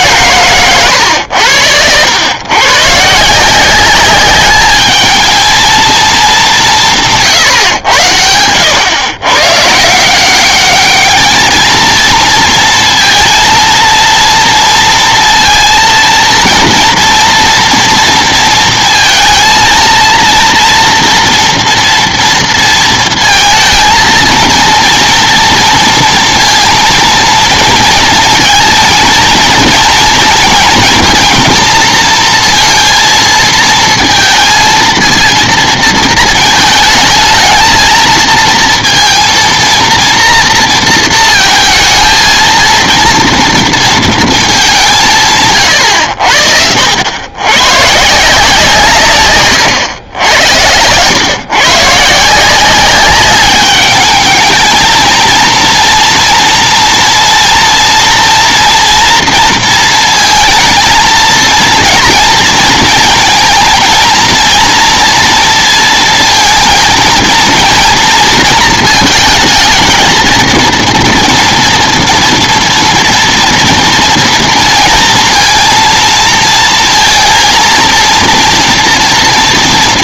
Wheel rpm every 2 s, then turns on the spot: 120, 120, 210, 200, 100, 200, 230, 230, 230, 230, 230, 230, 230, 230, 230, 230, 230, 230, 220, 230, 230, 230, 210, 80, 160, 100, 180, 220, 230, 240, 230, 230, 230, 230, 230, 230, 230, 230, 230, 230.
none